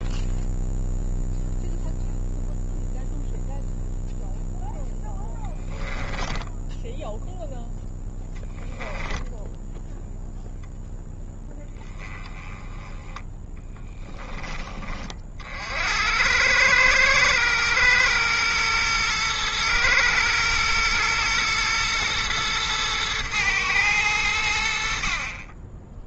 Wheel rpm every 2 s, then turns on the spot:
0, 0, 0, 0, 10, 0, 10, 30, 110, 110, 120, 110, 60.
none